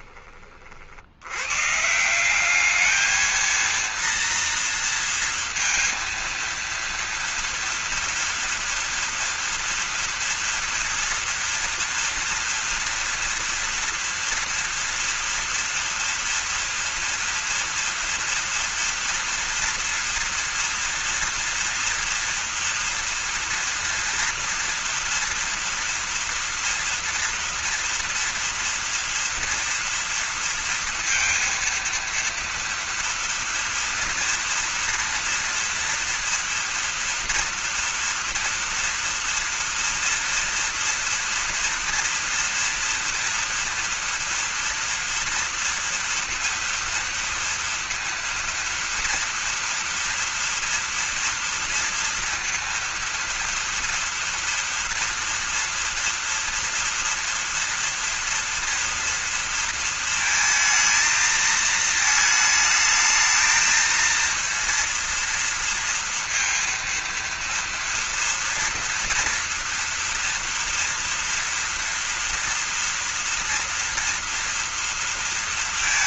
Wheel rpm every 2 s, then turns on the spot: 70, 210, 230, 230, 230, 230, 230, 230, 230, 230, 230, 230, 230, 230, 230, 230, 230, 230, 230, 230, 240, 230, 230, 230, 230, 240, 230, 230, 230, 240, 220, 220, 230, 230, 230, 230, 230, 230.
none